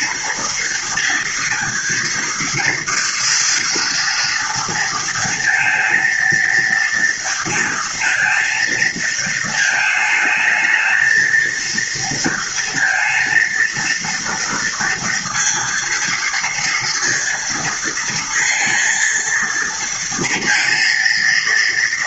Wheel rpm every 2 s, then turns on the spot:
230, 230, 230, 230, 220, 230, 230, 230, 230, 230, 230.
none